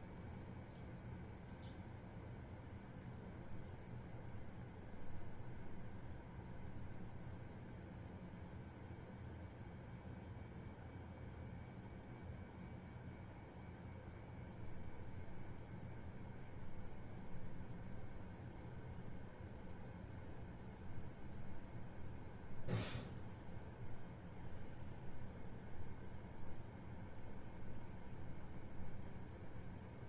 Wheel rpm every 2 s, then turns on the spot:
0, 0, 0, 0, 0, 0, 0, 0, 0, 0, 0, 0, 0, 0, 0.
none